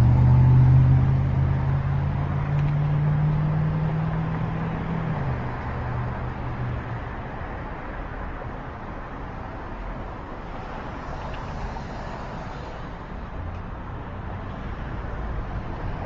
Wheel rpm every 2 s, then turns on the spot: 0, 0, 0, 0, 0, 0, 0, 0.
none